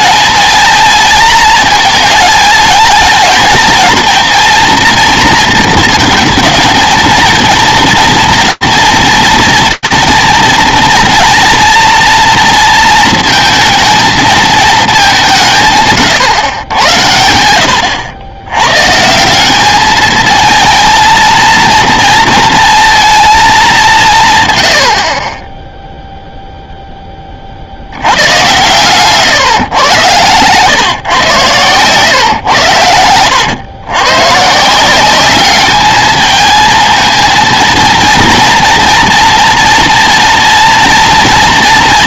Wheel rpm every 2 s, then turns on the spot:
230, 230, 230, 230, 230, 230, 230, 220, 120, 110, 220, 230, 110, 10, 130, 120, 90, 170, 220, 240, 230.
28-30